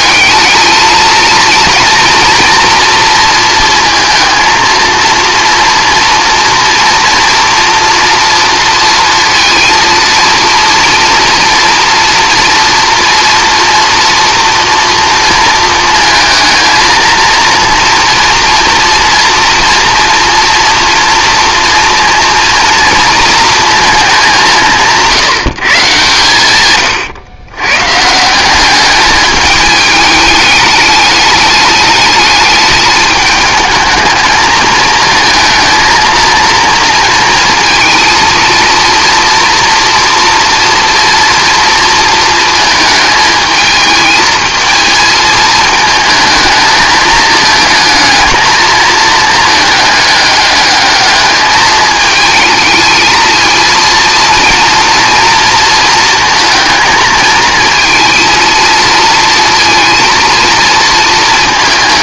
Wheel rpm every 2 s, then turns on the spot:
220, 230, 230, 230, 230, 230, 230, 230, 220, 230, 230, 230, 180, 120, 200, 210, 210, 220, 230, 230, 240, 220, 220, 220, 230, 210, 220, 230, 220, 230, 230.
none